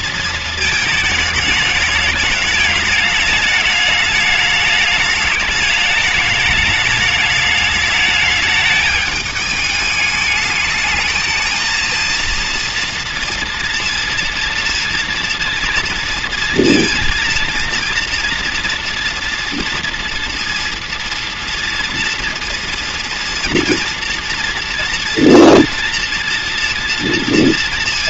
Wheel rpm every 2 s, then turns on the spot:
220, 210, 210, 210, 210, 210, 230, 230, 230, 230, 230, 230, 230, 230.
none